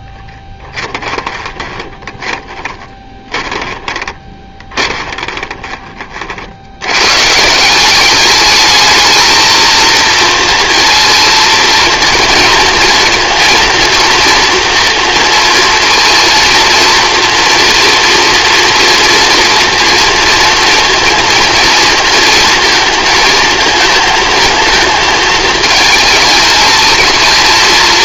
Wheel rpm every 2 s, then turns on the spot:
10, 10, 20, 80, 210, 230, 230, 240, 230, 230, 230, 220, 220, 220.
0-6